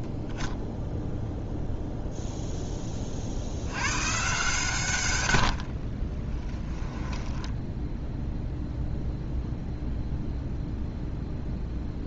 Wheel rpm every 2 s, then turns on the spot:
20, 20, 160, 10, 0, 0.
6-8